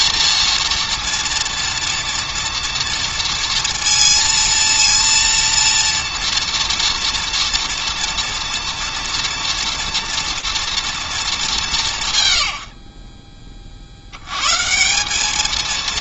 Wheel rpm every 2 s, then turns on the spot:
230, 230, 230, 230, 230, 240, 60, 150.
none